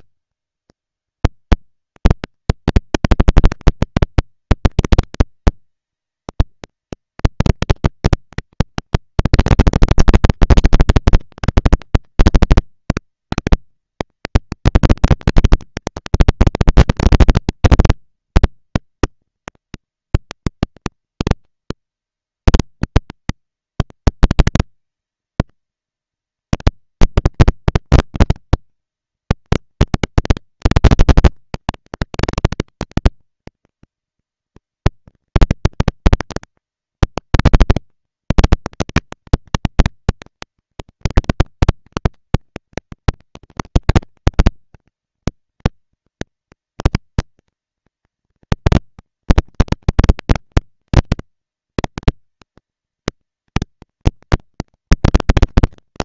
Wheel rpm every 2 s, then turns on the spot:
200, 210, 230, 220, 230, 230, 230, 220, 230, 230, 230, 230, 230, 230, 230, 230, 230, 230, 230, 230, 220, 190, 200, 220, 230, 230, 230, 230.
none